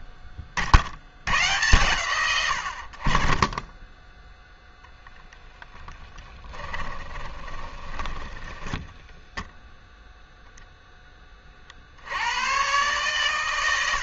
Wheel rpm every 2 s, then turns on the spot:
50, 80, 10, 20, 20, 10, 140.
6-10